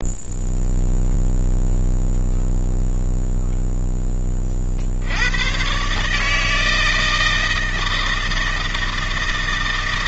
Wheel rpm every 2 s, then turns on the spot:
0, 0, 60, 160, 160.
none